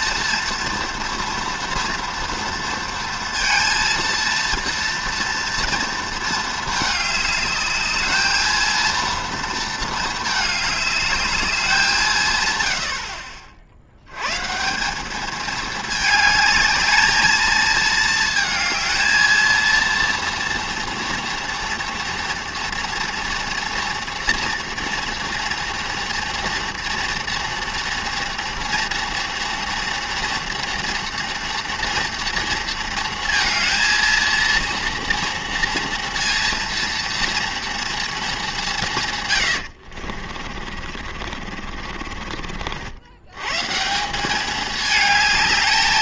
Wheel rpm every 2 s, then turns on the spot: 230, 230, 230, 210, 230, 210, 60, 190, 220, 220, 230, 230, 230, 230, 230, 230, 230, 230, 230, 130, 40, 90, 220.
40-42